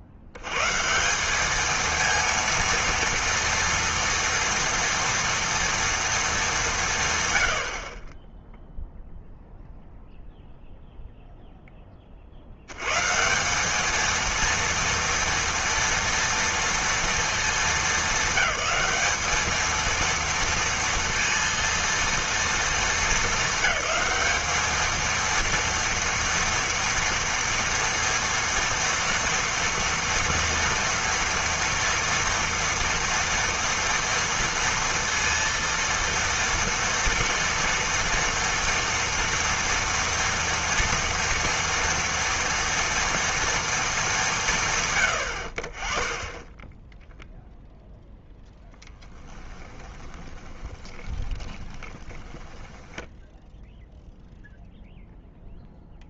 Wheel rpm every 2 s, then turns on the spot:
80, 230, 230, 190, 0, 0, 90, 230, 230, 210, 230, 230, 220, 230, 230, 230, 230, 230, 230, 230, 230, 230, 150, 10, 0, 20, 10, 0.
50-54